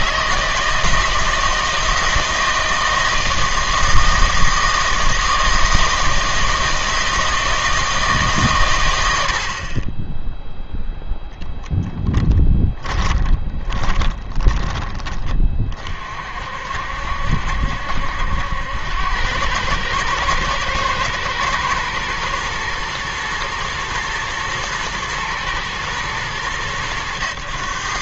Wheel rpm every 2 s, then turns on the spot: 160, 160, 160, 160, 120, 0, 20, 30, 60, 80, 110, 120, 120, 100.
12-14